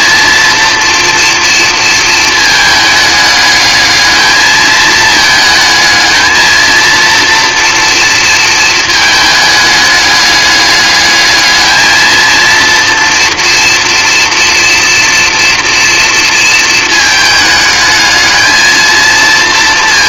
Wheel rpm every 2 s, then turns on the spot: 230, 220, 220, 230, 220, 210, 230, 230, 220, 230.
none